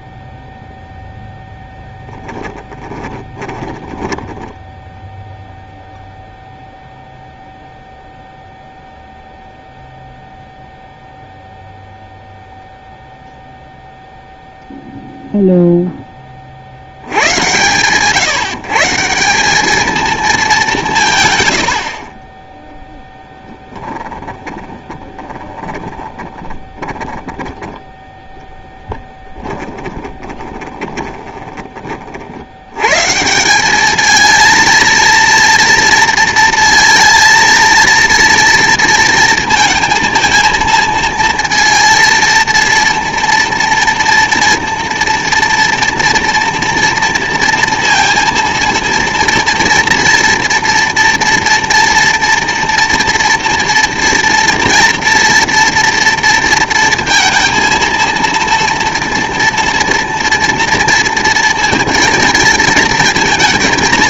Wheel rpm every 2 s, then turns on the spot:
10, 20, 10, 0, 0, 0, 0, 0, 80, 160, 180, 0, 20, 20, 10, 20, 100, 230, 230, 230, 230, 230, 230, 230, 230, 230, 230, 230, 230, 230, 240, 230.
2-6 24-28 30-32